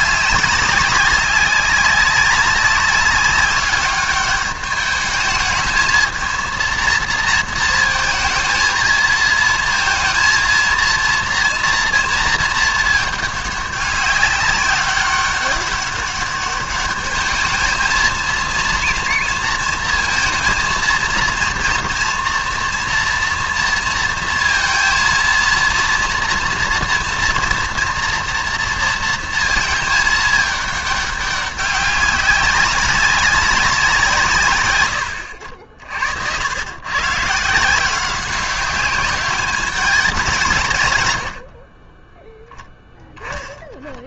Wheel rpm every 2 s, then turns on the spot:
200, 200, 210, 230, 230, 230, 220, 190, 200, 230, 230, 230, 230, 230, 230, 210, 200, 130, 110, 190, 140, 0.
none